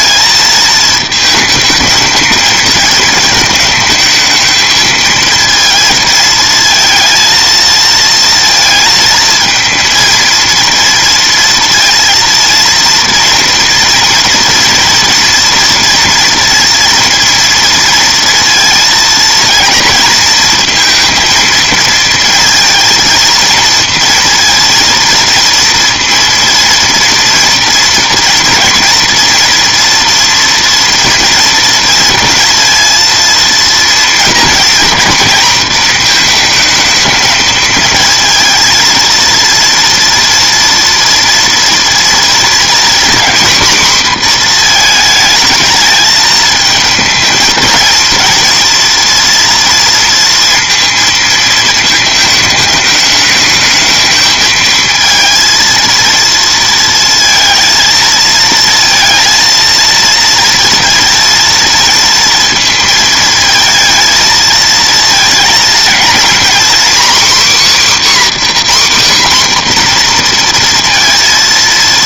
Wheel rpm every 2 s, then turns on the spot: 220, 230, 220, 230, 230, 230, 230, 230, 230, 230, 230, 220, 230, 230, 230, 230, 230, 230, 220, 230, 230, 240, 240, 220, 230, 230, 210, 220, 230, 230, 230, 230, 220, 260, 280, 240.
none